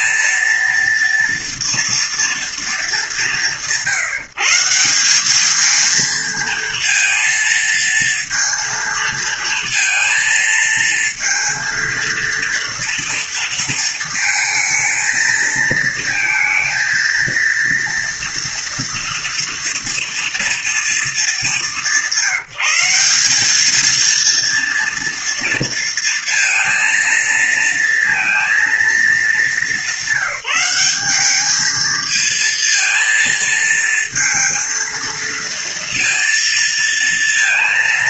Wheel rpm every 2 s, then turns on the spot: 230, 200, 180, 230, 230, 230, 230, 220, 230, 240, 230, 190, 230, 230, 220, 200, 230, 230, 230.
none